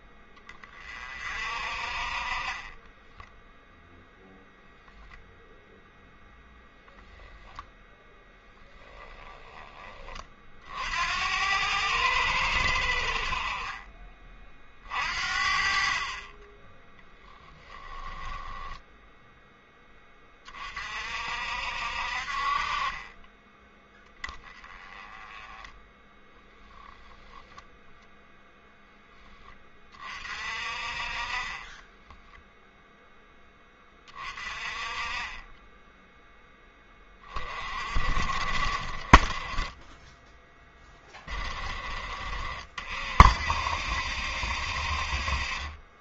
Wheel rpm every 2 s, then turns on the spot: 30, 20, 0, 10, 0, 60, 70, 50, 10, 10, 40, 30, 10, 0, 0, 40, 0, 30, 10, 40, 10, 60, 60.
2-4